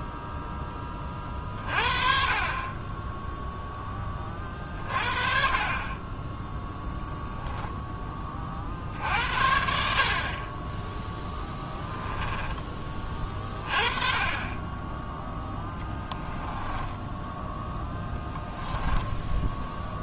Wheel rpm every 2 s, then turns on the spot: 10, 30, 40, 0, 50, 10, 20, 20, 10, 10.
16-18